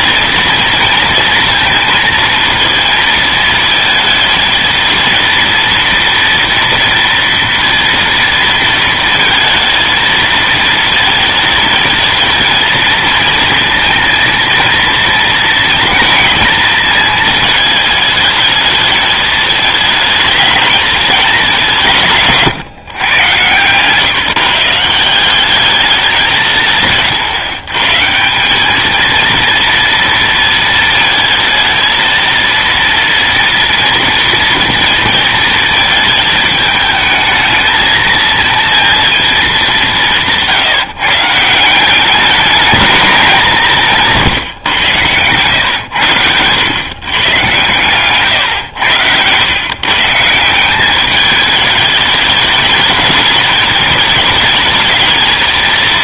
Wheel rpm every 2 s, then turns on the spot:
230, 230, 230, 230, 230, 230, 230, 230, 230, 220, 210, 130, 150, 160, 200, 230, 230, 230, 220, 230, 160, 200, 120, 120, 120, 190, 210, 220.
44-46